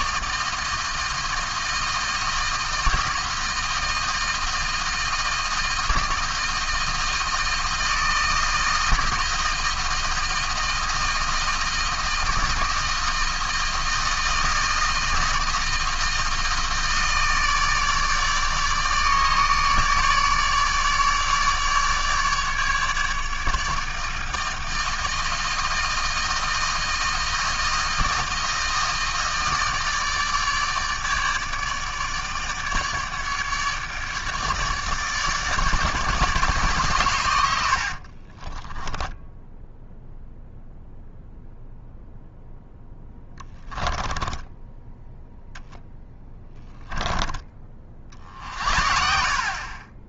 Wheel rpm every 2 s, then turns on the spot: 160, 160, 160, 160, 160, 160, 160, 160, 160, 150, 150, 150, 160, 160, 160, 150, 150, 150, 140, 20, 0, 0, 10, 10, 60.
38-40 44-46